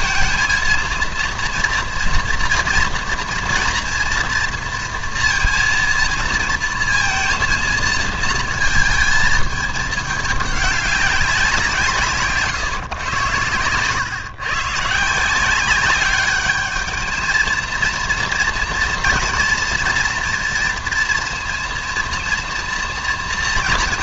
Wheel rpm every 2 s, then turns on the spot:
230, 230, 230, 230, 220, 200, 140, 140, 210, 240, 230, 230.
none